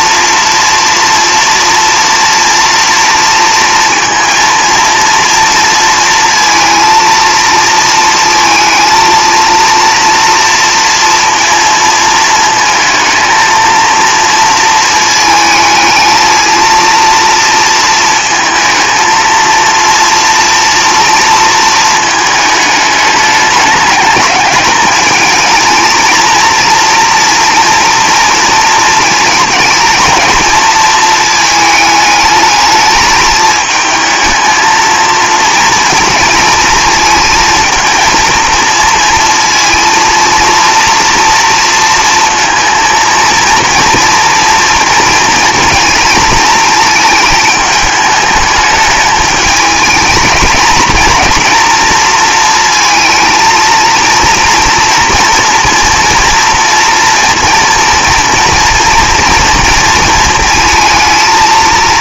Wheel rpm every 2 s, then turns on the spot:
240, 240, 230, 230, 230, 230, 230, 230, 230, 220, 230, 210, 210, 230, 230, 220, 220, 220, 220, 230, 230, 230, 230, 220, 210, 220, 230, 240, 240, 230, 220.
none